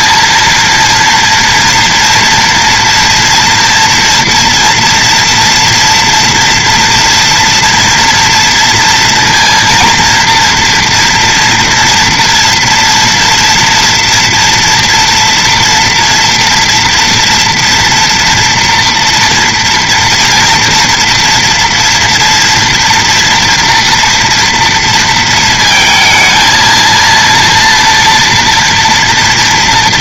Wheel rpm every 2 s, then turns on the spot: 230, 230, 230, 230, 230, 230, 230, 240, 230, 230, 230, 230, 230, 230, 230.
none